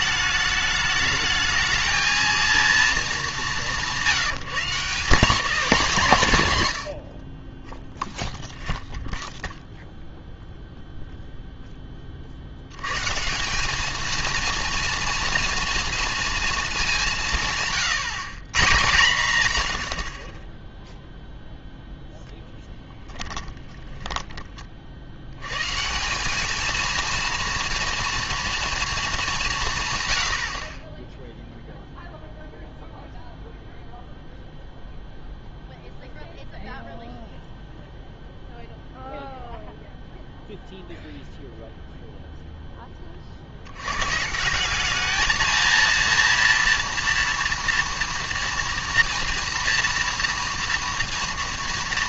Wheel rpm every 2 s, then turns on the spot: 210, 230, 180, 130, 0, 0, 80, 230, 220, 150, 20, 0, 30, 210, 230, 50, 0, 0, 0, 0, 0, 0, 160, 230, 230, 230.
none